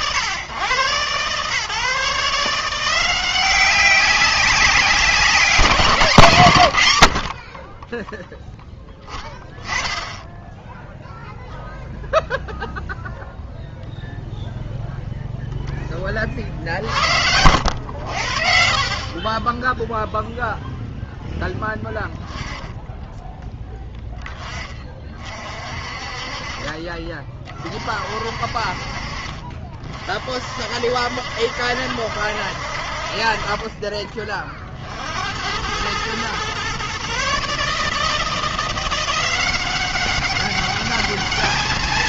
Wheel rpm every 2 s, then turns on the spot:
110, 160, 190, 110, 10, 0, 0, 0, 70, 50, 0, 10, 20, 30, 50, 50, 60, 40, 130, 170, 200.
none